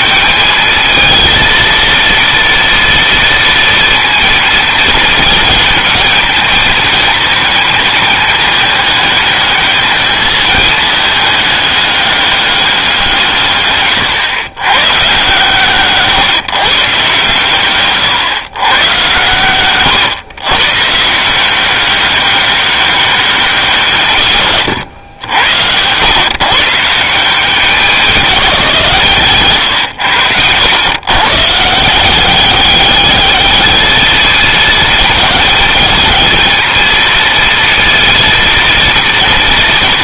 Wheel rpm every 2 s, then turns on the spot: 210, 230, 230, 220, 220, 220, 190, 130, 150, 130, 130, 190, 120, 160, 170, 110, 200, 220, 220, 230.
none